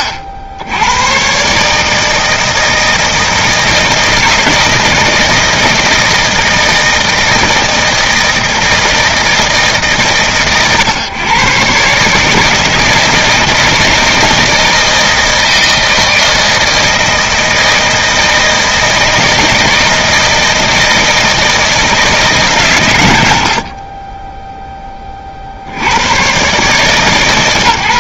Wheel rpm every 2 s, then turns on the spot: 80, 160, 160, 160, 160, 120, 160, 160, 160, 160, 160, 120, 20, 140.
none